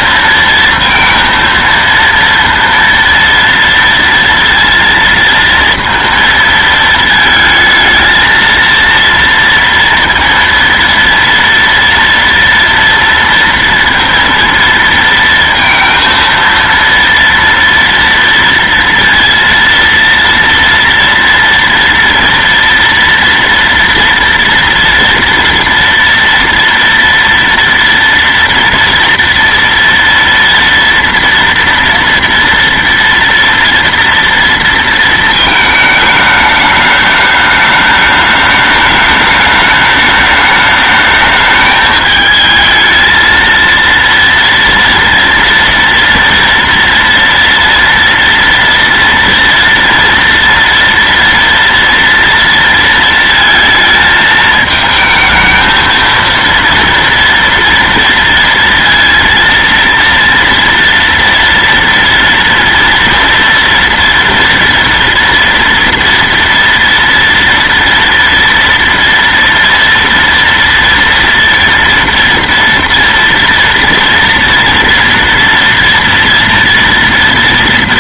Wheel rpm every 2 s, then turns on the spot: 230, 230, 230, 230, 230, 230, 230, 230, 230, 230, 230, 230, 230, 230, 230, 230, 230, 230, 210, 210, 210, 220, 230, 230, 230, 230, 230, 220, 230, 230, 230, 230, 230, 230, 230, 230, 230, 230, 230.
none